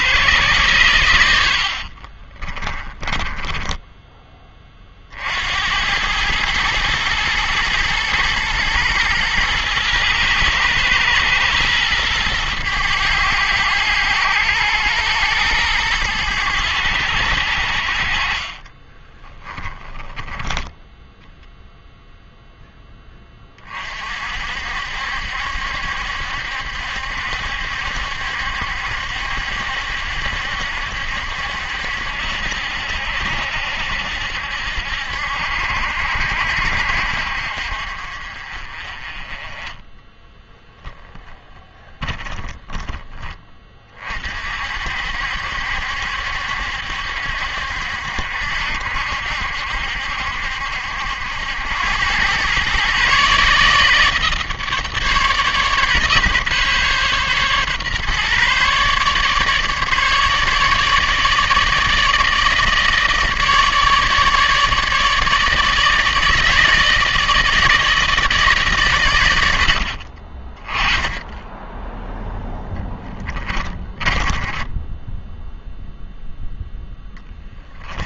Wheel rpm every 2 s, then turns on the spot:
120, 20, 30, 110, 120, 110, 100, 100, 100, 30, 10, 0, 60, 70, 70, 70, 70, 70, 60, 30, 10, 10, 50, 70, 60, 70, 130, 150, 140, 140, 150, 160, 150, 160, 140, 20, 10, 10, 0.
2-4 18-20 72-76